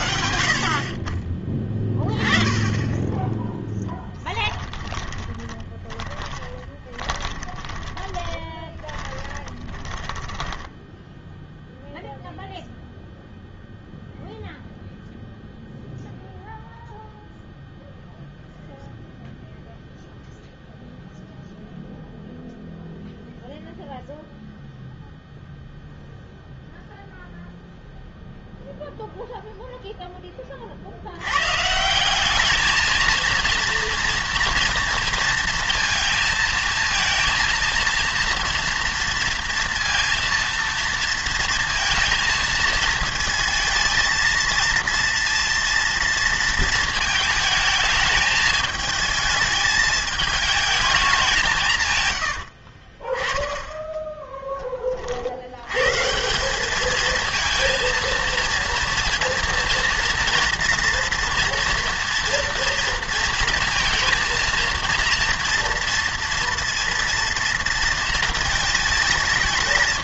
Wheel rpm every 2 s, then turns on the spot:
50, 10, 10, 10, 10, 10, 0, 0, 0, 0, 0, 0, 0, 0, 0, 40, 220, 230, 230, 230, 230, 220, 230, 230, 220, 220, 50, 20, 200, 230, 230, 230, 230, 230, 220.
4-12 52-54